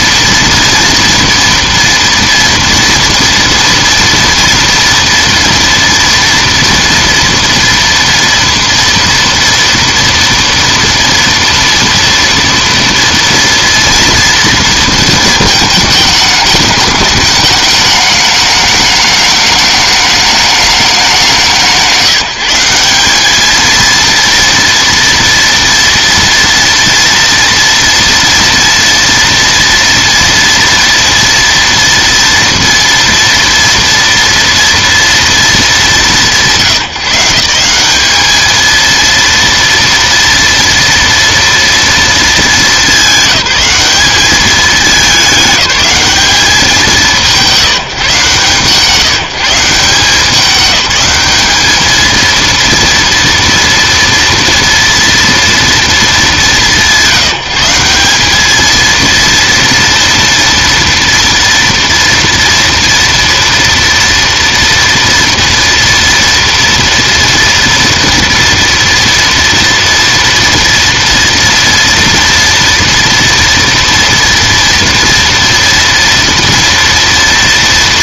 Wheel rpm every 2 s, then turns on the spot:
230, 230, 230, 230, 230, 230, 230, 230, 210, 210, 200, 180, 230, 230, 230, 230, 230, 230, 160, 220, 230, 220, 200, 180, 150, 200, 230, 230, 190, 220, 230, 230, 230, 230, 230, 230, 230, 230, 230.
none